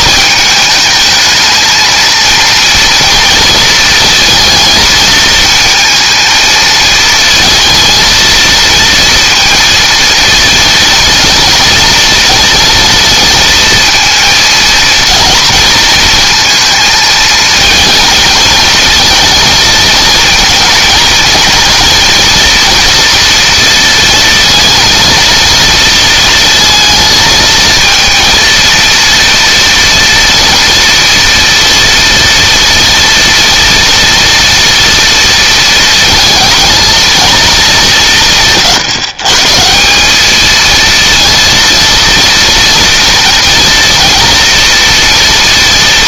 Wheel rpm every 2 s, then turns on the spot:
220, 230, 220, 220, 230, 230, 230, 230, 230, 220, 240, 240, 230, 230, 230, 230, 230, 230, 230, 160, 230, 230, 230.
none